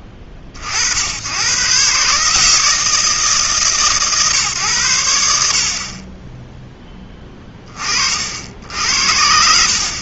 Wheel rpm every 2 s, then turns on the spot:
60, 160, 110, 0, 50.
none